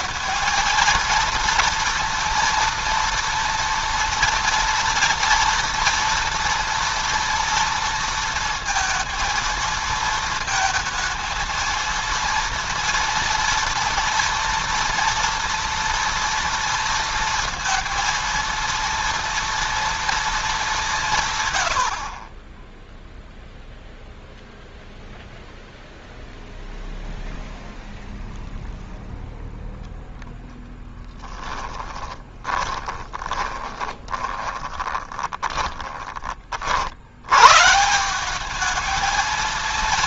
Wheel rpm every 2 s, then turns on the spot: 230, 230, 230, 230, 230, 230, 230, 230, 230, 230, 180, 0, 0, 0, 0, 10, 20, 20, 60, 210.
30-36